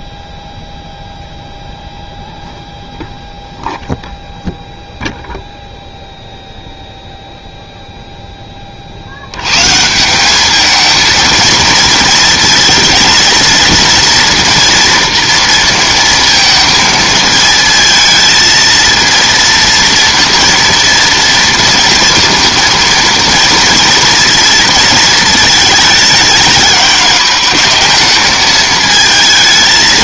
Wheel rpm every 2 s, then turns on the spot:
10, 0, 0, 0, 30, 220, 230, 230, 230, 230, 230, 230, 230, 210, 220.
none